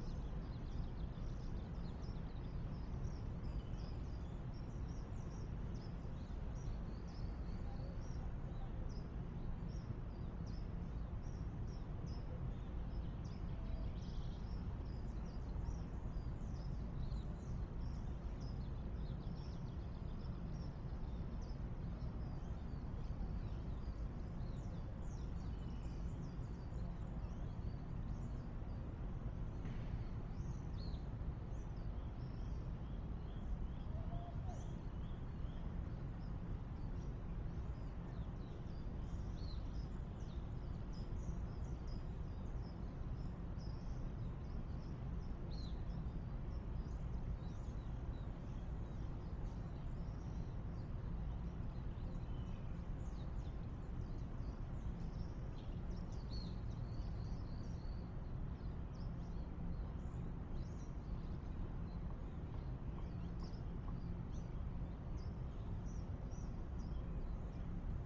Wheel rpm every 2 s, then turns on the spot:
0, 0, 0, 0, 0, 0, 0, 0, 0, 0, 0, 0, 0, 0, 0, 0, 0, 0, 0, 0, 0, 0, 0, 0, 0, 0, 0, 0, 0, 0, 0, 0, 0, 0.
none